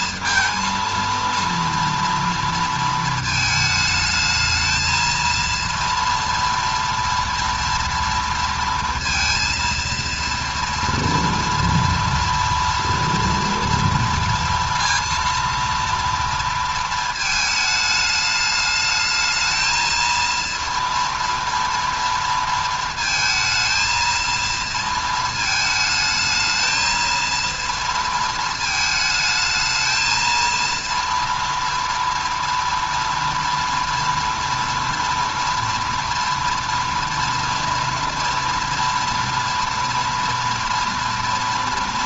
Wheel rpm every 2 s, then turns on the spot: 230, 230, 220, 230, 230, 230, 230, 230, 230, 210, 230, 230, 230, 220, 220, 230, 230, 230, 230, 230, 230.
none